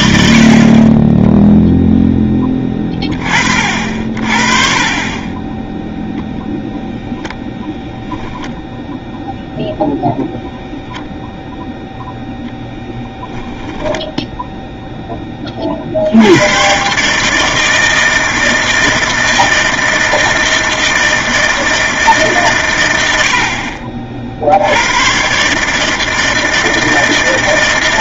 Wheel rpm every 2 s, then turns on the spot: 20, 20, 30, 0, 10, 0, 0, 0, 130, 160, 160, 110, 90, 160.
none